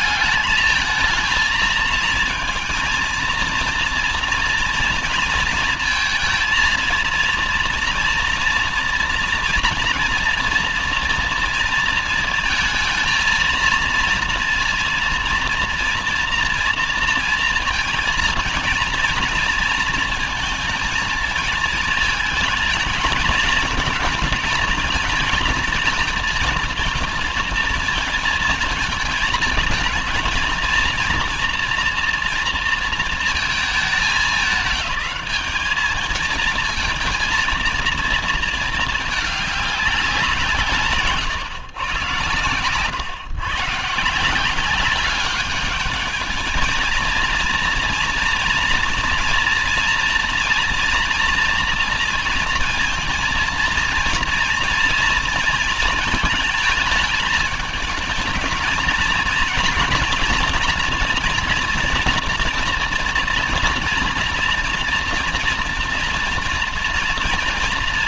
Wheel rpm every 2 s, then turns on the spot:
220, 230, 230, 230, 240, 230, 230, 230, 230, 230, 220, 220, 220, 220, 220, 230, 230, 210, 230, 220, 160, 130, 190, 220, 230, 230, 230, 230, 220, 230, 240, 240, 230, 230.
none